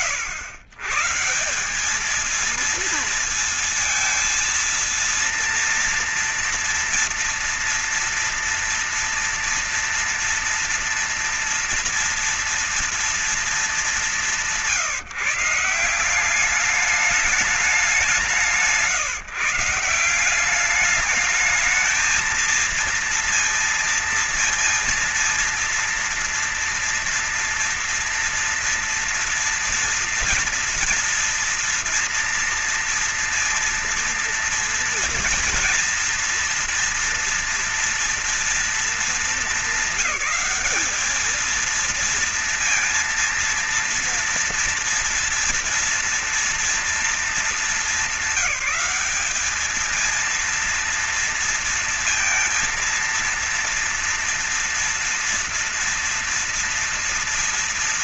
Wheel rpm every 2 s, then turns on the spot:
130, 230, 230, 230, 230, 240, 240, 190, 190, 160, 190, 230, 230, 230, 230, 230, 230, 230, 230, 230, 210, 230, 240, 230, 190, 230, 230, 230, 230.
none